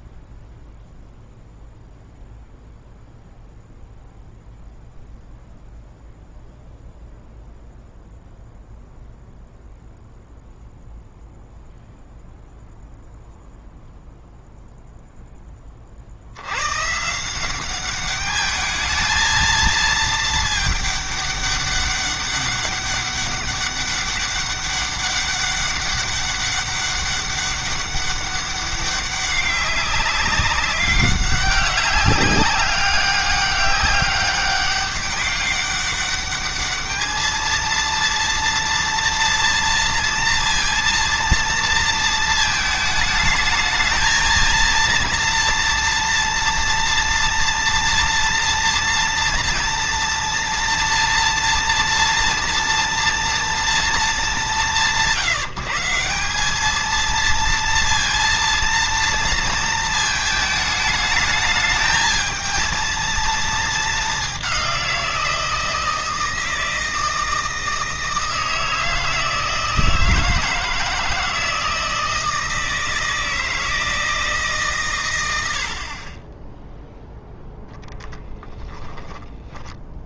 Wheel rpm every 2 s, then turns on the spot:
0, 0, 0, 0, 0, 0, 0, 0, 140, 210, 210, 200, 200, 200, 190, 190, 200, 200, 210, 230, 230, 220, 230, 230, 240, 230, 230, 180, 220, 230, 210, 230, 180, 160, 160, 160, 160, 130, 0, 10.
78-80